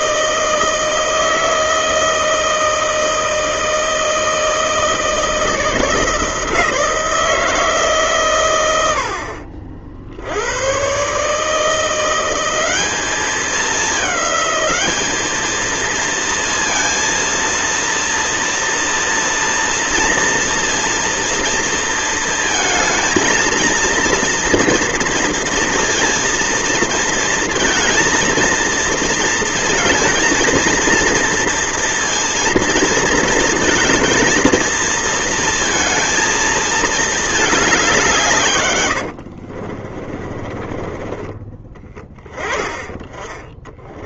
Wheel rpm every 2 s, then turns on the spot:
160, 160, 160, 160, 90, 120, 200, 210, 230, 230, 230, 220, 230, 230, 230, 230, 230, 230, 220, 90, 20, 10.
38-42